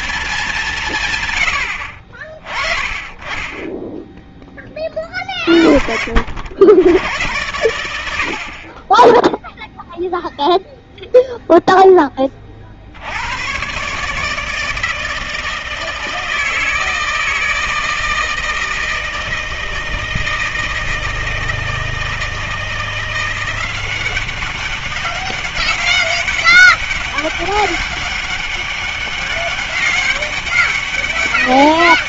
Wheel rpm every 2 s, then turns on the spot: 190, 30, 20, 80, 50, 0, 40, 160, 160, 160, 160, 170, 190, 200, 200, 200.
none